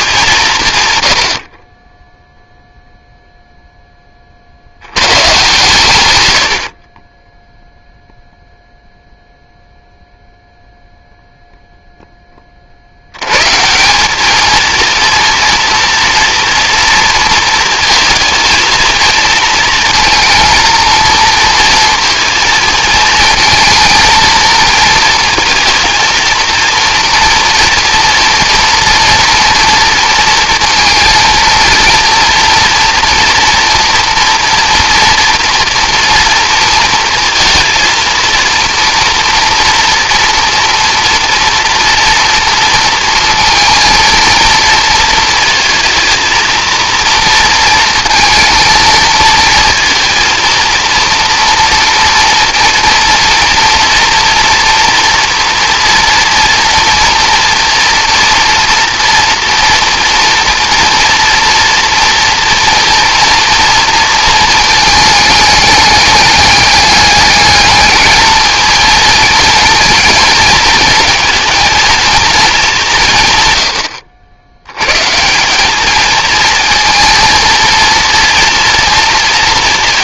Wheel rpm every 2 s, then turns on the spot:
120, 0, 110, 30, 0, 0, 60, 230, 240, 220, 230, 230, 230, 230, 230, 230, 230, 230, 220, 230, 230, 230, 230, 230, 230, 230, 230, 230, 230, 230, 230, 230, 220, 210, 220, 230, 190, 110, 230, 230.
none